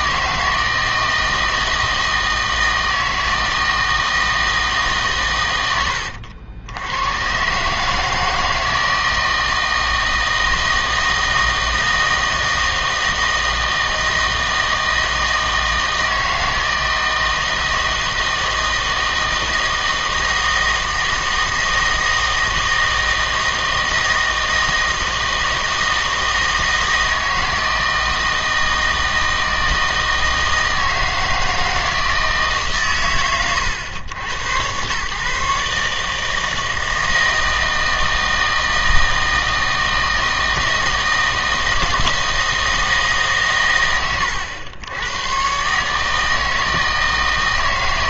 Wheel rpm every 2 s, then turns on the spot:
160, 160, 160, 80, 160, 160, 160, 160, 160, 160, 160, 160, 160, 160, 160, 160, 140, 100, 160, 160, 160, 160, 100, 160.
none